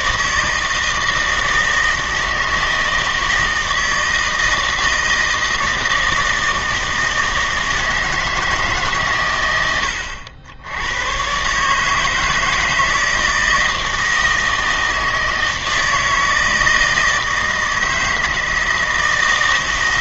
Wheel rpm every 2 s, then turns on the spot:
160, 160, 160, 160, 150, 80, 160, 160, 160, 160.
none